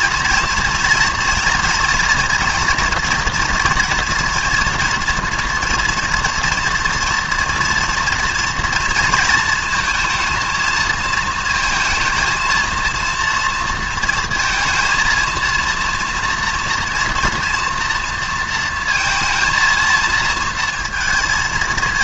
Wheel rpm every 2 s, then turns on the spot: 230, 230, 230, 230, 230, 220, 230, 220, 230, 230, 230.
none